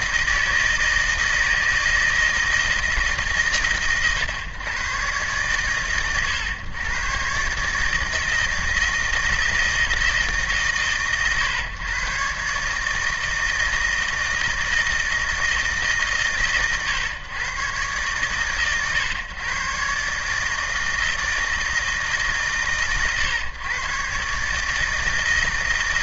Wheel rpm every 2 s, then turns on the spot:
160, 160, 120, 120, 160, 130, 150, 160, 120, 110, 160, 130, 160.
none